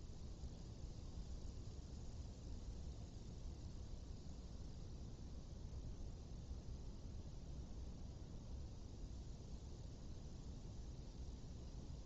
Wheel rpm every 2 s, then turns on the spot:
0, 0, 0, 0, 0, 0.
none